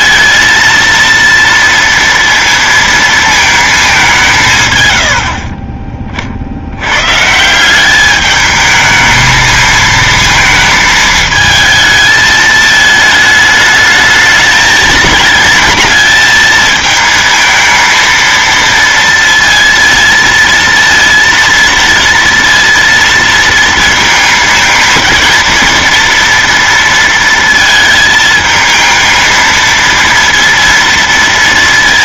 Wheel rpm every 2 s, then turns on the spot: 230, 230, 130, 80, 220, 220, 220, 220, 220, 230, 230, 230, 220, 230, 220, 230.
none